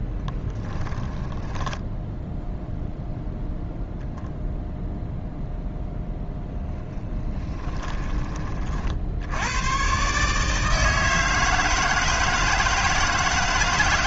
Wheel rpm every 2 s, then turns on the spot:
10, 0, 0, 30, 50, 150, 160.
0-2 6-8